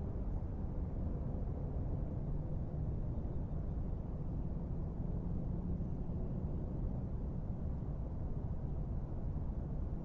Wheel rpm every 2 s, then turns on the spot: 0, 0, 0, 0, 0.
none